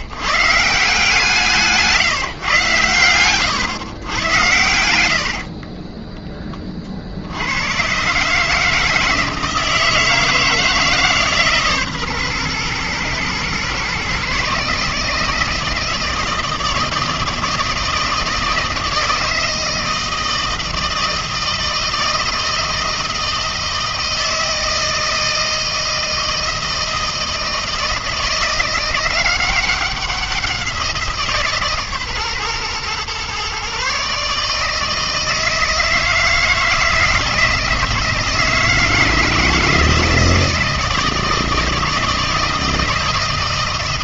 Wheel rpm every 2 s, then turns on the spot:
150, 140, 110, 20, 150, 160, 120, 140, 160, 160, 160, 160, 160, 160, 170, 180, 130, 150, 160, 160, 160, 160.
none